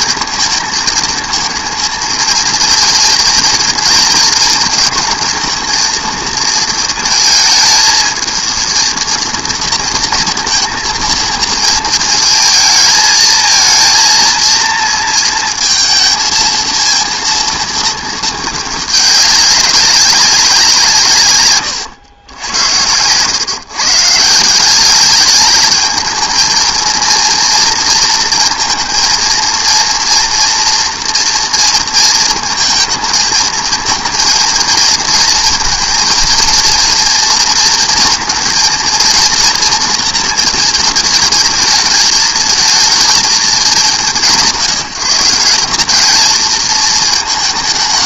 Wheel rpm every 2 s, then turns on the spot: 230, 230, 230, 220, 230, 230, 220, 230, 230, 210, 180, 90, 180, 230, 230, 230, 230, 230, 230, 230, 230, 220, 190, 220.
none